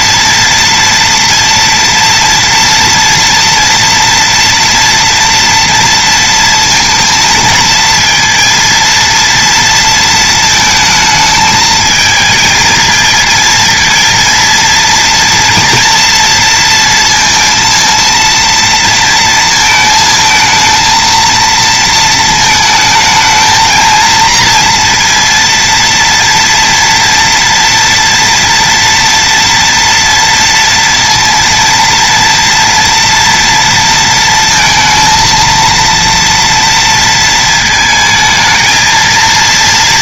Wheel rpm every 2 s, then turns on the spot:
230, 230, 230, 230, 230, 220, 230, 230, 230, 230, 220, 220, 230, 240, 230, 230, 230, 220, 230, 230.
none